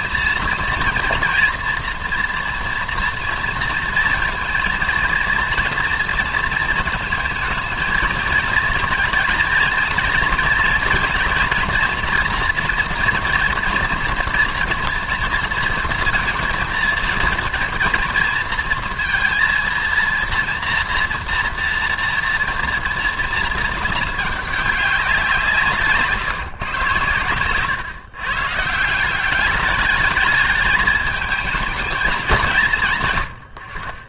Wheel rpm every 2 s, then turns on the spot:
230, 230, 230, 220, 220, 230, 240, 230, 230, 230, 230, 230, 210, 140, 150, 210, 170.
none